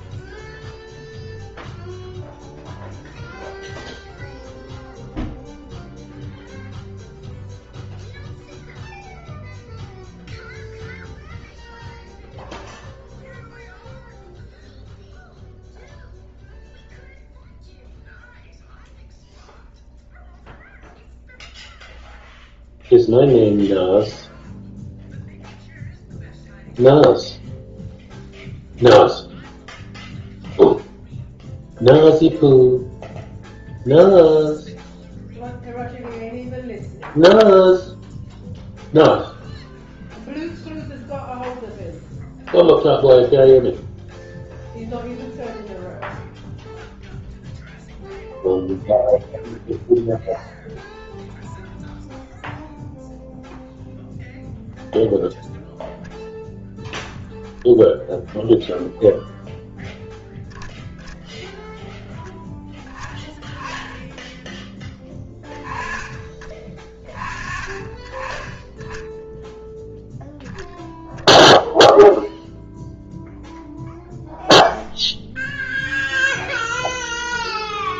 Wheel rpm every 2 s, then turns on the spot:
0, 0, 0, 0, 0, 0, 0, 0, 0, 0, 0, 0, 0, 0, 0, 0, 0, 0, 0, 0, 0, 0, 0, 0, 0, 0, 0, 0, 0, 0, 0, 10, 10, 20, 10, 0, 0, 0, 0.
none